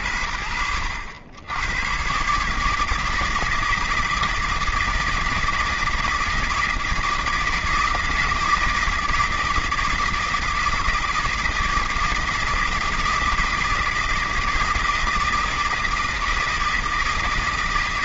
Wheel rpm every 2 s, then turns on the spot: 70, 150, 160, 160, 160, 160, 160, 160, 160.
none